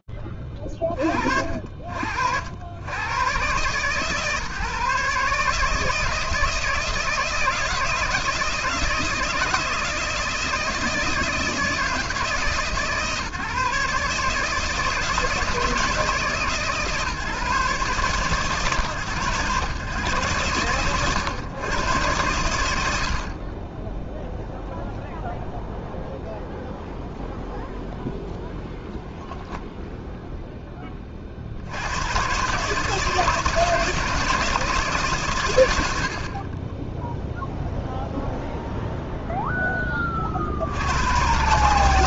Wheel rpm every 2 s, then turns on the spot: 50, 140, 160, 160, 160, 160, 150, 160, 140, 120, 120, 20, 0, 0, 10, 60, 160, 120, 0, 0, 110.
none